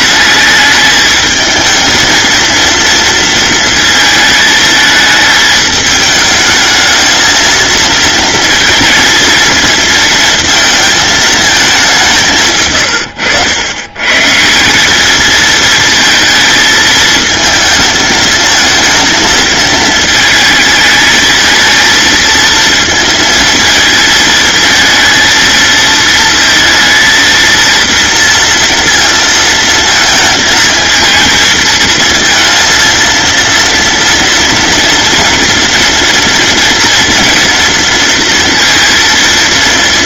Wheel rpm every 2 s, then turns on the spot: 220, 230, 220, 220, 230, 220, 90, 220, 220, 220, 220, 230, 230, 230, 230, 220, 230, 230, 240, 230.
none